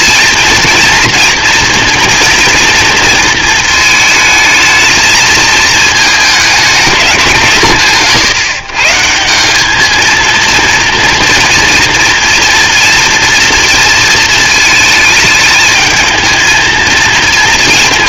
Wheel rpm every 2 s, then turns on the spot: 230, 230, 220, 200, 160, 230, 230, 220, 230.
none